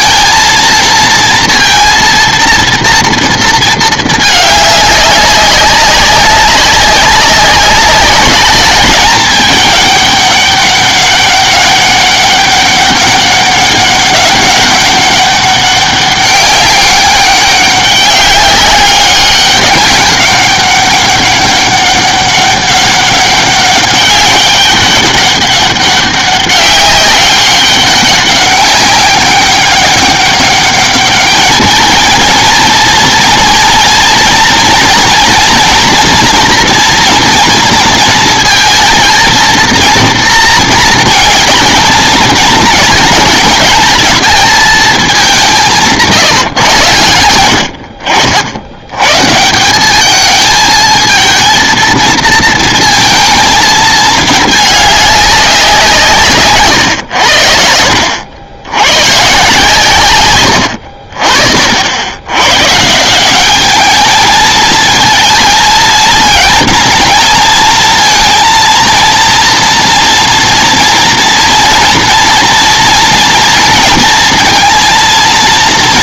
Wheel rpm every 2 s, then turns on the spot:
230, 230, 210, 200, 210, 200, 200, 200, 200, 200, 200, 200, 200, 200, 200, 200, 230, 240, 230, 220, 230, 220, 220, 130, 80, 220, 220, 210, 120, 90, 90, 130, 220, 230, 230, 230, 230, 230.
60-62